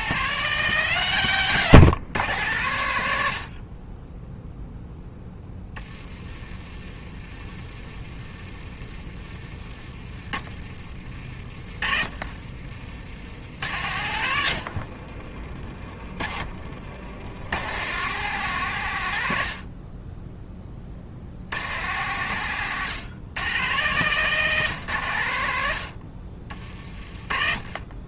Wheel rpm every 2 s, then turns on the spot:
160, 100, 10, 30, 30, 40, 70, 70, 70, 120, 50, 120, 120, 40.
10-12 14-16 26-28